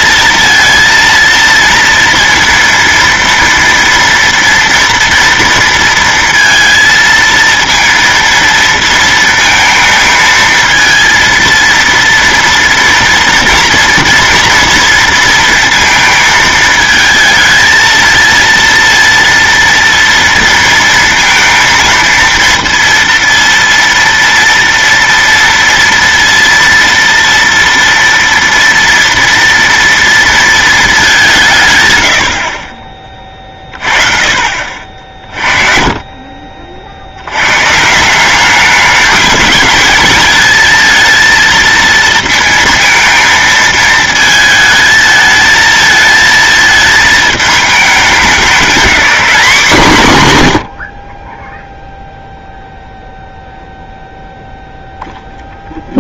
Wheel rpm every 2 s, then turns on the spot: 230, 230, 230, 230, 230, 220, 230, 230, 220, 230, 230, 230, 230, 230, 230, 220, 40, 40, 50, 200, 230, 230, 220, 220, 210, 110, 0, 0.
none